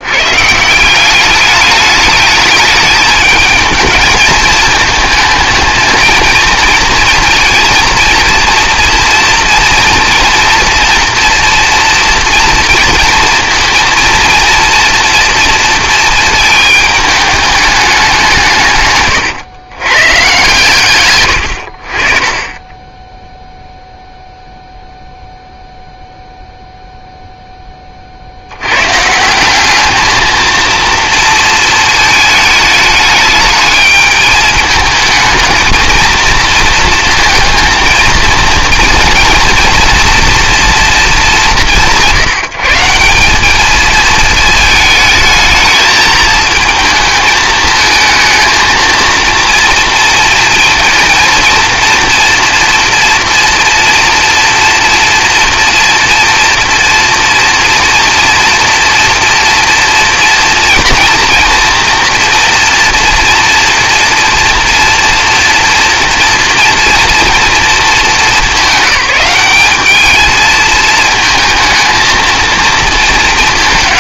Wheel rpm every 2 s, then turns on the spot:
170, 210, 220, 230, 230, 230, 230, 230, 220, 130, 130, 10, 0, 0, 110, 230, 210, 220, 230, 230, 230, 160, 220, 220, 230, 230, 240, 230, 230, 240, 240, 230, 230, 230, 210, 220, 230.
18-20